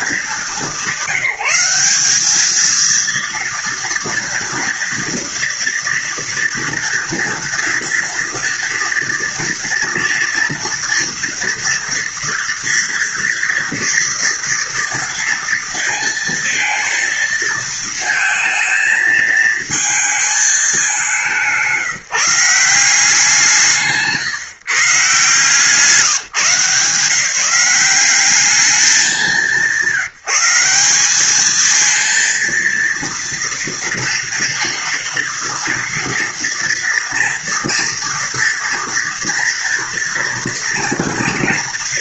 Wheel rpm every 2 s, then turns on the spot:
200, 220, 230, 230, 230, 230, 230, 230, 230, 220, 210, 180, 140, 170, 200, 180, 230, 240, 230, 230, 230.
none